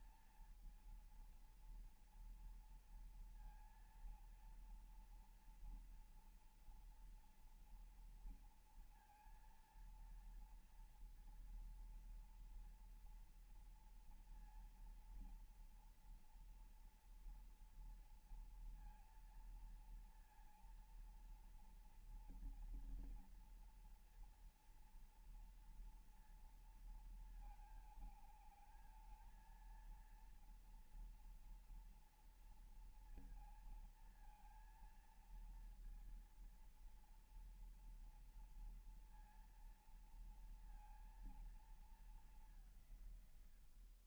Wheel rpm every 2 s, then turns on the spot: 230, 230, 230, 230, 230, 230, 230, 230, 230, 230, 230, 230, 230, 230, 220, 230, 230, 230, 230, 230, 230, 190.
none